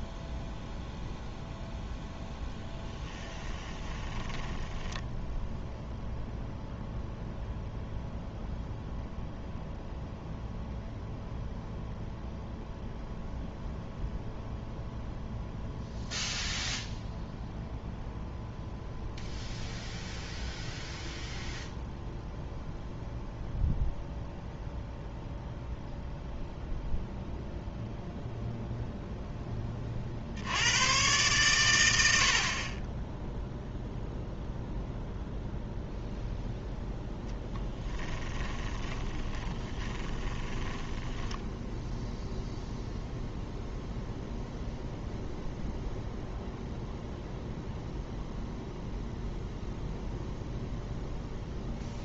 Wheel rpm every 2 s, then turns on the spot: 0, 10, 10, 0, 0, 0, 0, 0, 0, 0, 0, 0, 0, 0, 0, 110, 30, 0, 0, 20, 10, 0, 0, 0, 0, 0.
2-6 38-42